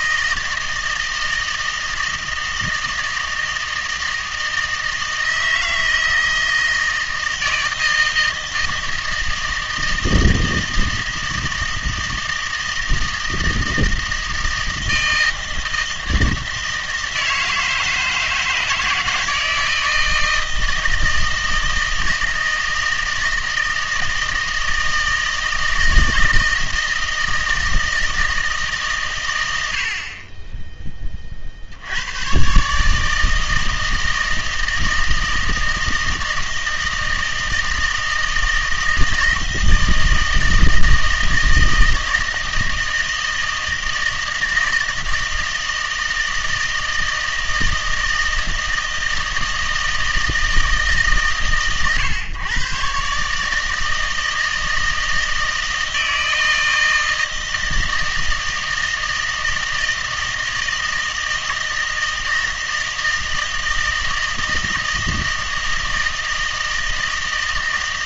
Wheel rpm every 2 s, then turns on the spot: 160, 160, 160, 160, 160, 160, 160, 160, 160, 160, 160, 160, 160, 160, 140, 20, 140, 160, 160, 160, 160, 160, 160, 160, 160, 150, 130, 160, 160, 160, 160, 160, 160, 160.
none